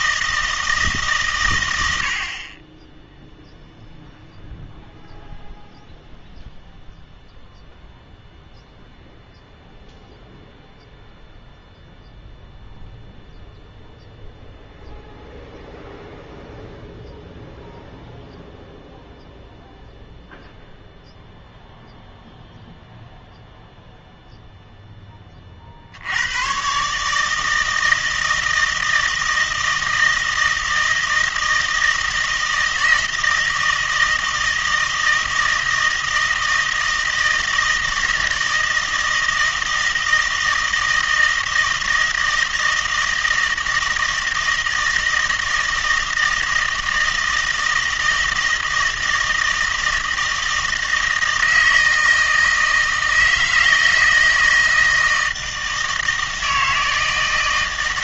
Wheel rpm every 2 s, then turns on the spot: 160, 20, 0, 0, 0, 0, 0, 0, 0, 0, 0, 0, 0, 130, 160, 160, 160, 160, 160, 160, 160, 160, 160, 160, 160, 160, 160, 160, 160.
none